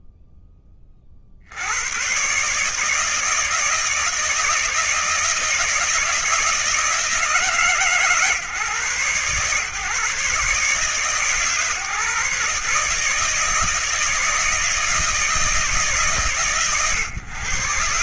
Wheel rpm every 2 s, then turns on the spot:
20, 140, 160, 160, 140, 130, 150, 160, 120.
none